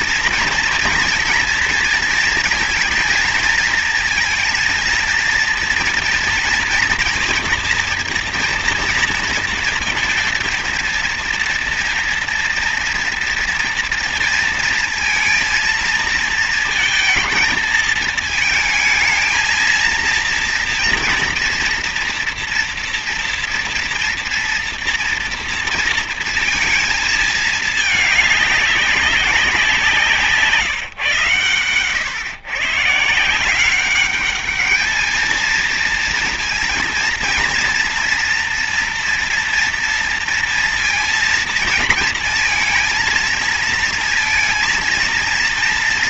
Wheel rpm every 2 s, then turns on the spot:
230, 230, 230, 230, 230, 230, 240, 230, 230, 220, 230, 230, 230, 230, 200, 160, 130, 210, 230, 230, 230, 230, 230.
none